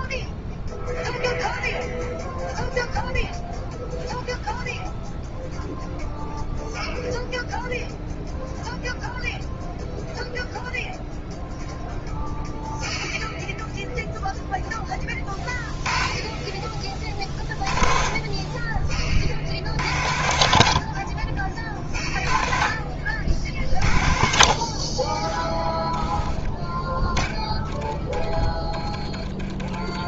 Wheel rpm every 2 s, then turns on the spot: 0, 0, 0, 0, 0, 0, 0, 0, 30, 30, 60, 40, 50, 20, 20.
28-30